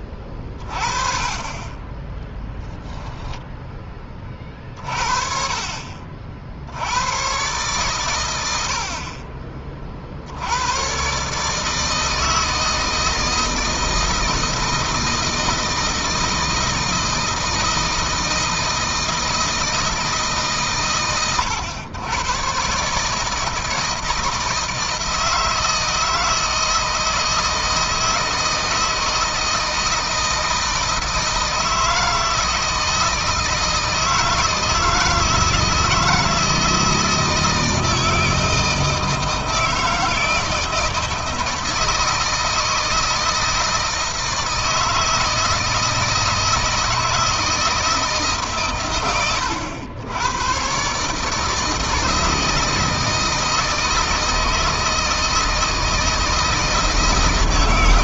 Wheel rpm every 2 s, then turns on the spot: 40, 20, 40, 70, 80, 100, 160, 160, 160, 160, 130, 130, 160, 160, 160, 160, 160, 160, 160, 160, 160, 160, 160, 160, 130, 130, 160, 160, 160.
none